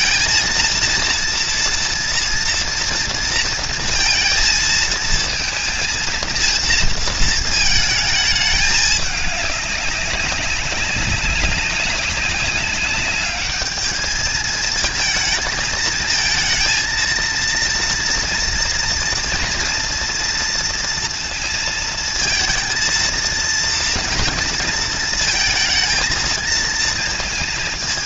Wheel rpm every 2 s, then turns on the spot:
230, 230, 230, 230, 210, 190, 200, 220, 230, 230, 230, 230, 230, 220.
none